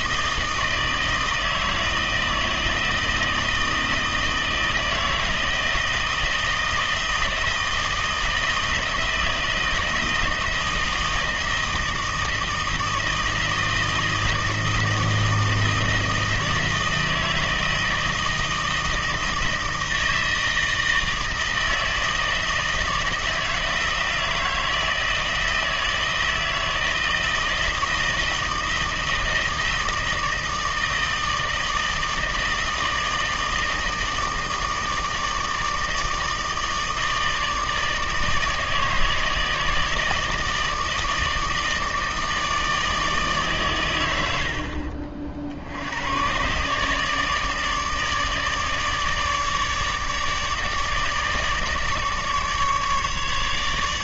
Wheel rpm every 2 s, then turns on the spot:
160, 160, 160, 160, 160, 160, 160, 160, 160, 160, 160, 160, 160, 160, 160, 160, 160, 160, 160, 150, 160, 160, 60, 130, 150, 160, 150.
44-46